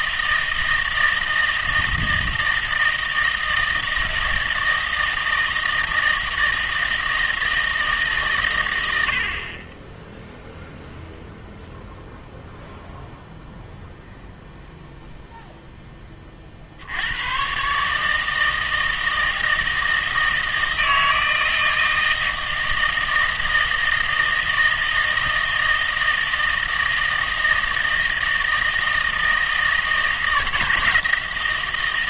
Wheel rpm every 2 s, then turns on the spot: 160, 160, 160, 160, 110, 0, 0, 0, 60, 160, 160, 160, 160, 160, 160, 160.
none